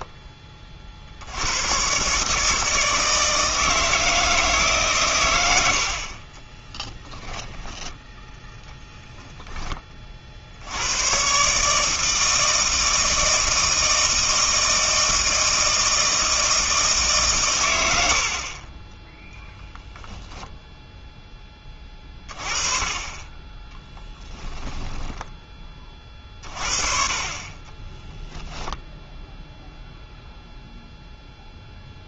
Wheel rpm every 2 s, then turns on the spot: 30, 160, 150, 10, 0, 80, 160, 160, 160, 10, 0, 30, 20, 40, 0, 0.
6-8 24-26